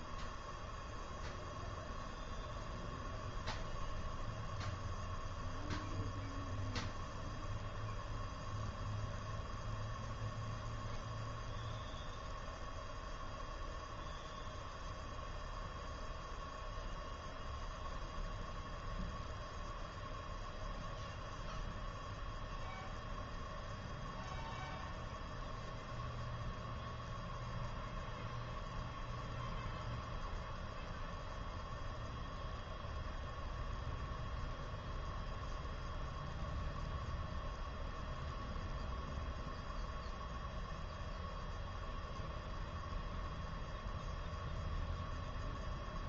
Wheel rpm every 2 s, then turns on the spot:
0, 0, 0, 0, 0, 0, 0, 0, 0, 0, 0, 0, 0, 0, 0, 0, 0, 0, 0, 0, 0, 0, 0.
none